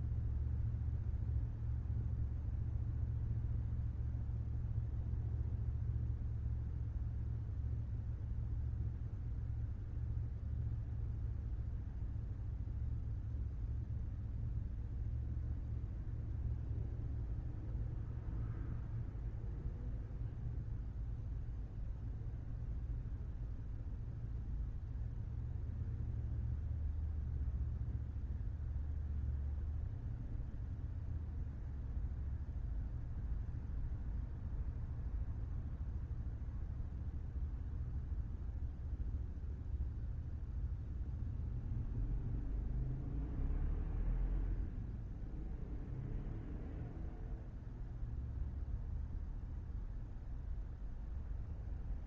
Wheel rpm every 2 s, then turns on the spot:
0, 0, 0, 0, 0, 0, 0, 0, 0, 0, 0, 0, 0, 0, 0, 0, 0, 0, 0, 0, 0, 0, 0, 0, 0, 0.
none